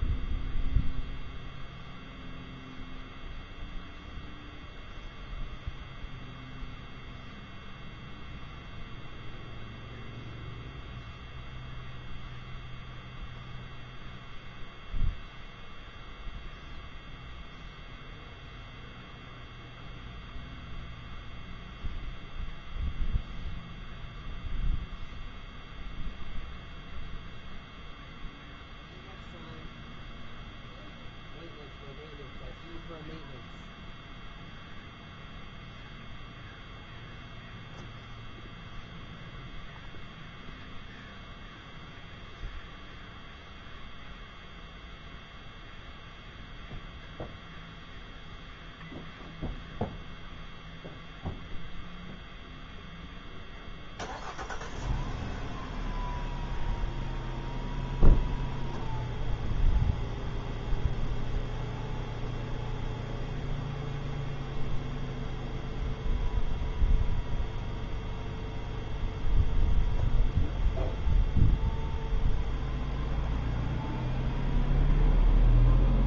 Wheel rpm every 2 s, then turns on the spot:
0, 0, 0, 0, 0, 0, 0, 0, 0, 0, 0, 0, 0, 0, 0, 0, 0, 0, 0, 0, 0, 0, 0, 0, 0, 0, 0, 0, 0, 0, 0, 0, 0, 0, 0, 0, 0, 0.
none